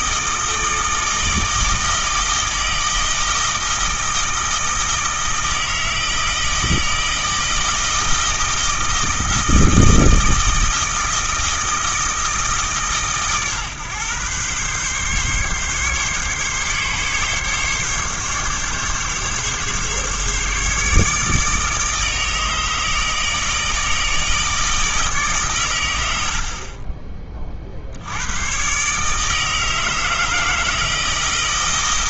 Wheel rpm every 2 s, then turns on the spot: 160, 160, 160, 160, 170, 160, 140, 130, 140, 140, 150, 160, 160, 40, 140, 160.
none